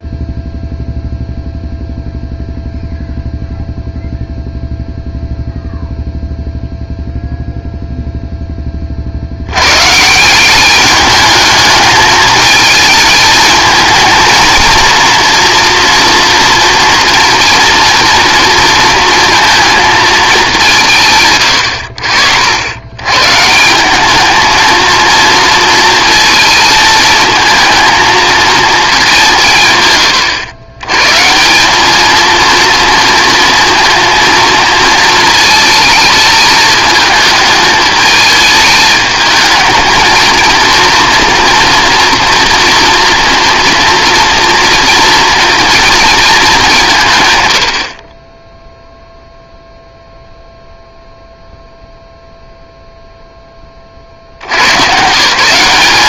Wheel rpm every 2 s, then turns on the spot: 0, 0, 0, 0, 20, 200, 220, 230, 230, 230, 170, 100, 230, 220, 220, 110, 230, 230, 210, 220, 230, 240, 230, 190, 0, 0, 0, 120.
none